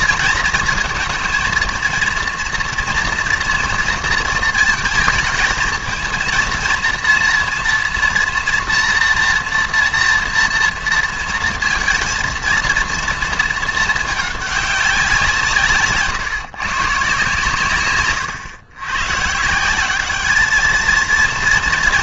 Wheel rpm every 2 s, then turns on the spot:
230, 230, 230, 230, 230, 230, 230, 200, 140, 110, 210.
none